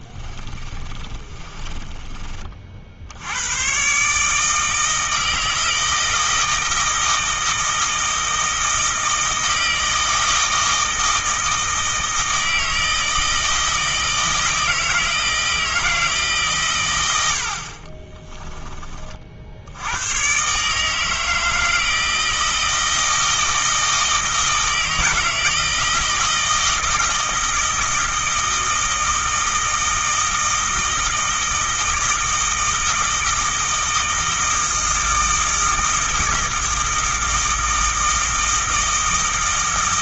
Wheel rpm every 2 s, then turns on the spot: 30, 40, 160, 160, 160, 160, 160, 160, 130, 20, 140, 160, 160, 160, 160, 160, 160, 160, 160, 160.
0-2